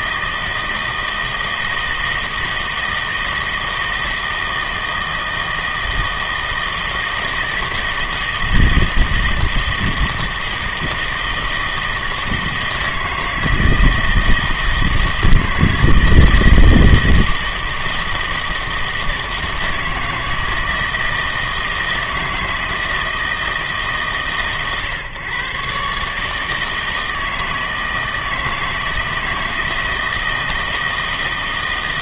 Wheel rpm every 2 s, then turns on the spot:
160, 160, 160, 160, 160, 160, 160, 160, 160, 160, 160, 160, 130, 160, 160, 160.
none